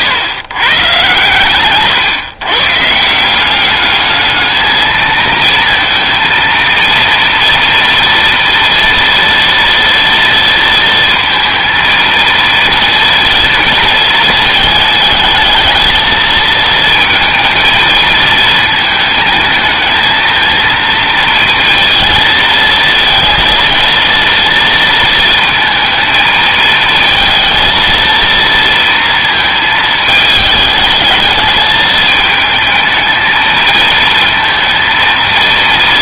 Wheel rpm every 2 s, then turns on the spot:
140, 150, 220, 230, 230, 230, 230, 220, 220, 220, 230, 230, 230, 220, 230, 210, 220, 230.
none